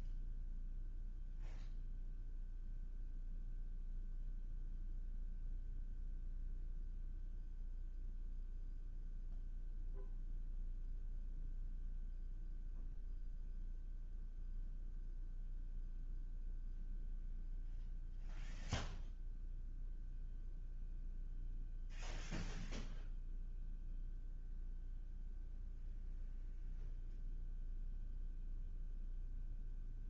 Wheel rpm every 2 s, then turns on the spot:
0, 0, 0, 0, 0, 0, 0, 0, 0, 0, 0, 0, 0, 0, 0.
none